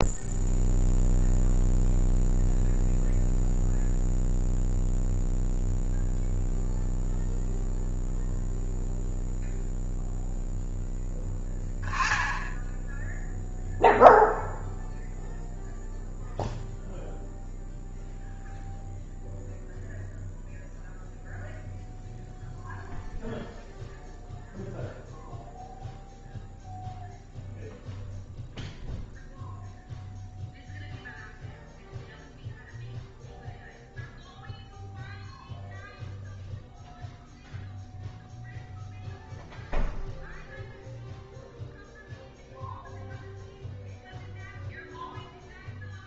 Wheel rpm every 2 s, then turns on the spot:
0, 0, 0, 0, 0, 10, 10, 0, 0, 0, 0, 0, 0, 0, 0, 0, 0, 0, 0, 0, 0, 0, 0.
none